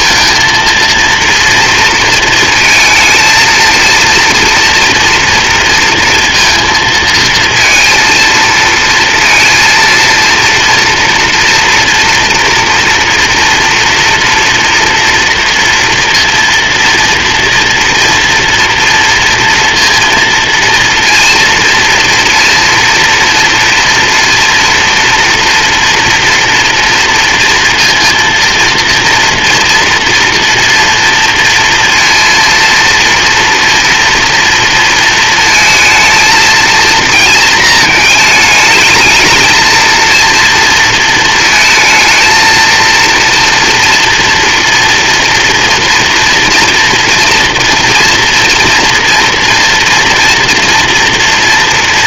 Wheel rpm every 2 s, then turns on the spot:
230, 220, 230, 220, 230, 240, 230, 230, 230, 230, 230, 230, 230, 230, 230, 230, 230, 220, 220, 220, 230, 230, 230, 230, 230, 240.
none